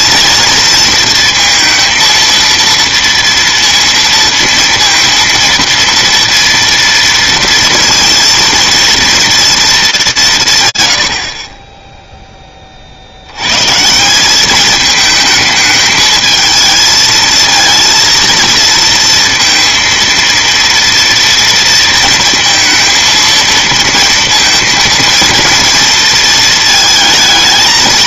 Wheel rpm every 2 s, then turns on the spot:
230, 230, 230, 230, 230, 140, 30, 210, 220, 230, 230, 230, 230, 220.
none